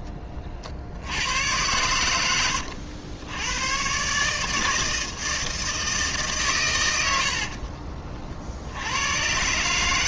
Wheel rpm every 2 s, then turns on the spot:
70, 80, 160, 100, 90.
none